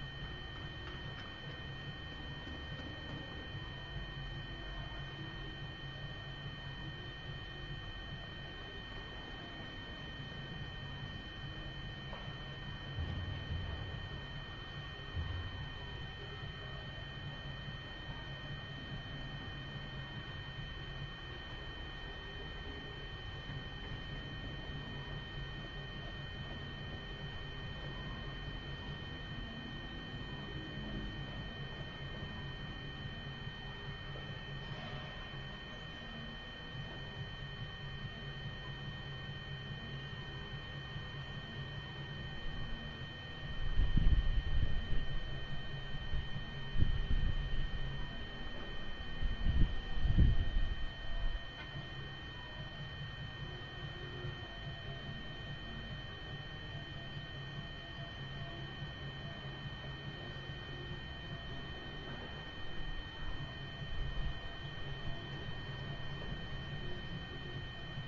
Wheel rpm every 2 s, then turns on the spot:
0, 0, 0, 0, 0, 0, 0, 0, 0, 0, 0, 0, 0, 0, 0, 0, 0, 0, 0, 0, 0, 0, 0, 0, 0, 0, 0, 0, 0, 0, 0, 0, 0, 0.
none